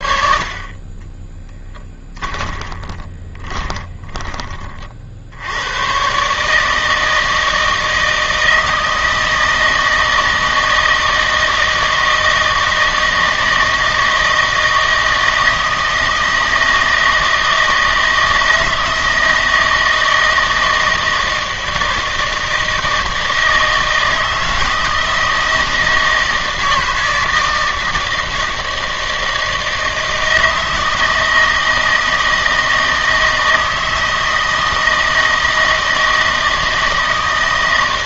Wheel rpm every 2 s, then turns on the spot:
40, 20, 30, 150, 160, 160, 160, 160, 160, 160, 160, 160, 160, 160, 160, 160, 160, 160, 160.
2-4